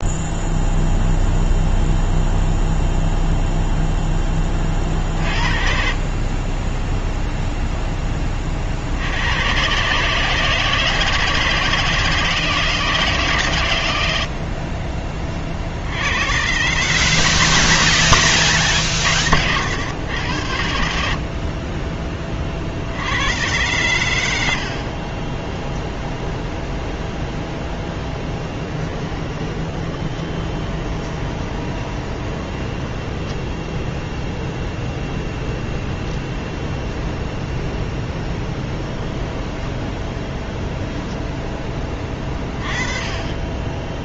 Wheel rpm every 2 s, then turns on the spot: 0, 0, 30, 10, 50, 160, 160, 50, 120, 140, 80, 50, 60, 0, 10, 20, 20, 0, 0, 10, 0, 20.
24-26 28-34 38-40